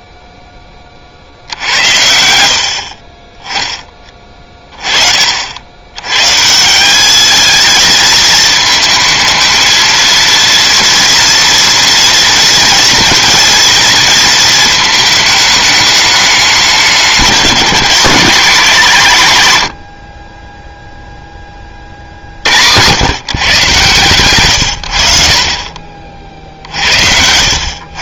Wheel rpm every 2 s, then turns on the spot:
60, 20, 40, 210, 220, 230, 230, 220, 200, 150, 10, 120, 40, 80.
none